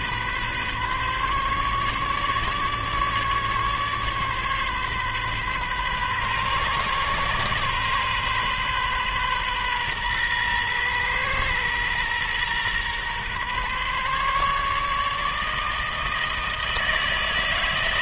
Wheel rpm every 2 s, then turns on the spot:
130, 150, 140, 130, 130, 120, 120, 150, 160.
none